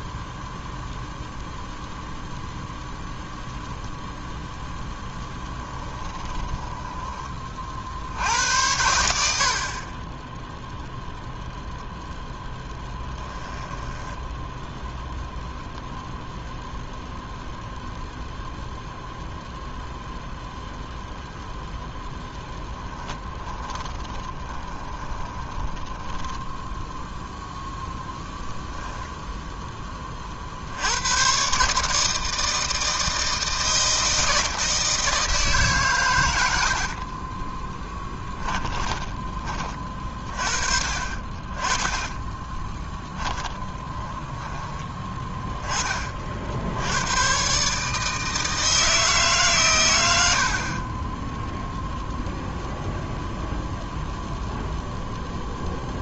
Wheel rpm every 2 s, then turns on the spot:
0, 0, 0, 20, 80, 0, 10, 0, 0, 0, 0, 10, 30, 10, 0, 70, 160, 160, 90, 20, 40, 20, 10, 80, 160, 30, 0, 0.
6-8 12-14 22-26 38-40 42-44